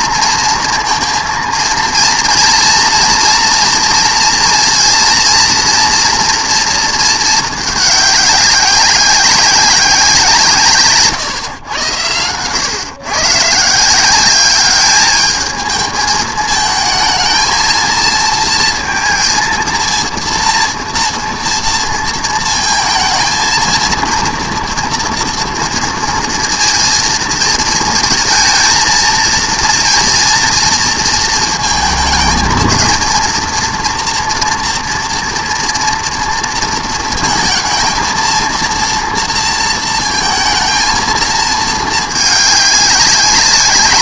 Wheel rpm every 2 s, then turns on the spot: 230, 230, 230, 230, 190, 160, 110, 200, 220, 230, 230, 230, 230, 230, 230, 230, 230, 230, 230, 230, 220, 200.
none